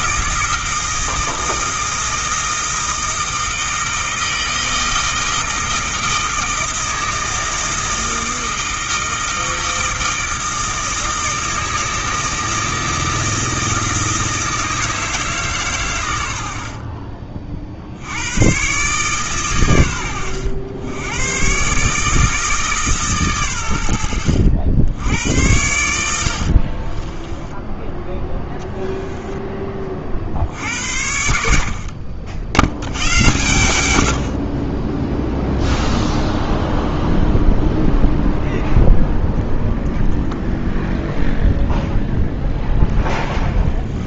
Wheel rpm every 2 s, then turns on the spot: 160, 160, 160, 160, 160, 160, 160, 160, 50, 130, 100, 150, 80, 30, 10, 80, 90, 20, 0, 0, 0, 10.
26-28